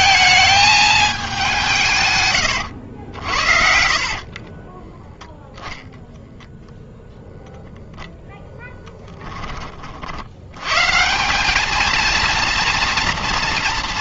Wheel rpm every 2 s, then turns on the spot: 220, 110, 20, 0, 10, 120, 230.
2-6